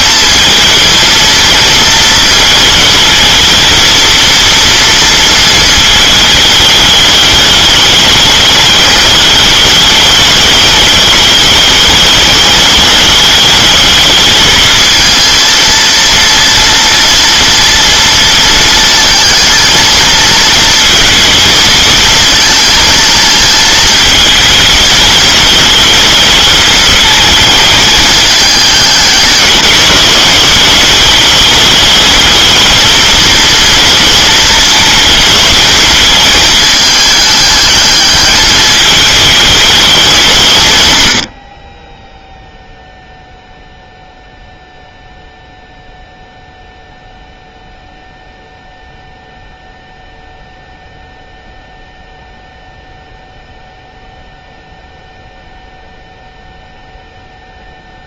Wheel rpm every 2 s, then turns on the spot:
230, 220, 230, 210, 210, 210, 210, 220, 230, 230, 230, 230, 220, 220, 210, 200, 220, 220, 210, 220, 130, 0, 0, 0, 0, 0, 0, 0, 0.
none